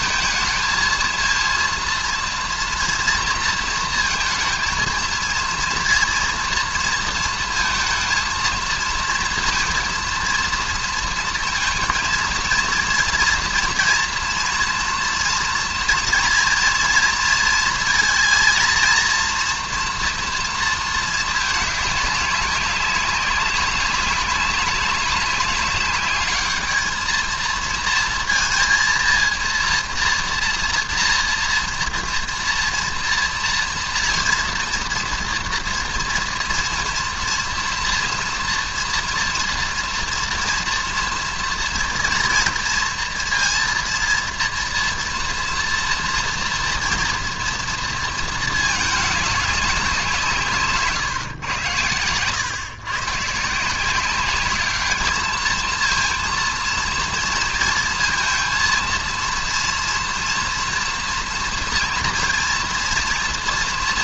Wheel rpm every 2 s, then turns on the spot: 230, 230, 230, 230, 230, 230, 230, 240, 230, 230, 230, 200, 190, 220, 230, 230, 230, 240, 230, 230, 240, 230, 230, 240, 220, 150, 130, 200, 230, 230, 230, 230.
50-52